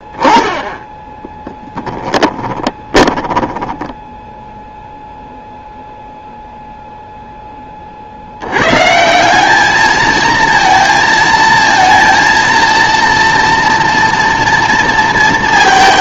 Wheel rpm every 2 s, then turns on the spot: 10, 10, 0, 0, 150, 230, 230, 230.
2-4